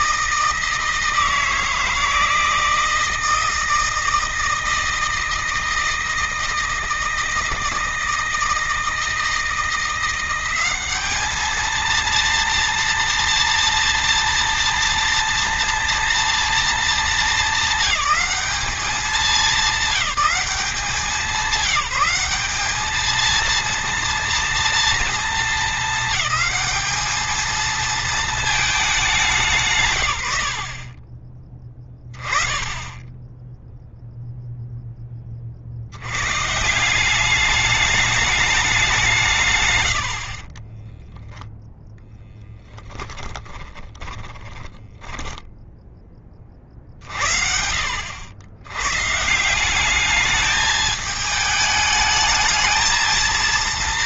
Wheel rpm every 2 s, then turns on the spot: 160, 160, 160, 160, 160, 200, 230, 230, 210, 210, 200, 210, 230, 220, 210, 70, 20, 0, 130, 200, 20, 10, 20, 40, 120, 210, 220.
44-46